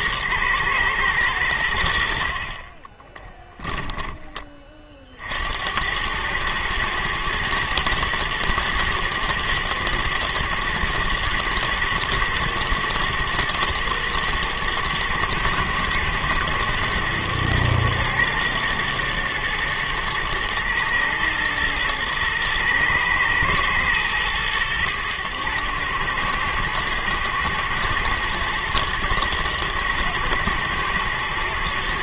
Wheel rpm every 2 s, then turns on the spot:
110, 30, 20, 110, 120, 110, 110, 110, 110, 120, 110, 120, 110, 110, 120, 110.
2-4